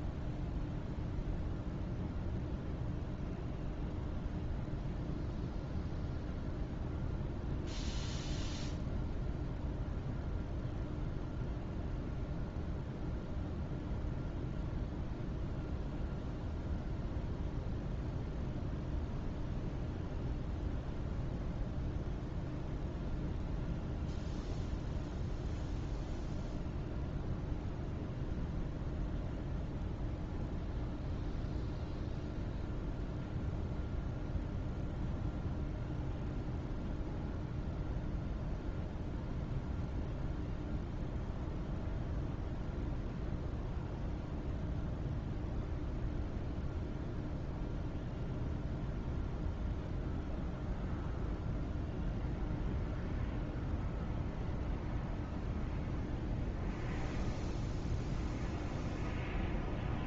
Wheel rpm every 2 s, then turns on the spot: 0, 0, 0, 0, 0, 0, 0, 0, 0, 0, 0, 0, 0, 0, 0, 0, 0, 0, 0, 0, 0, 0, 0, 0, 0, 0, 0, 0, 0, 0.
none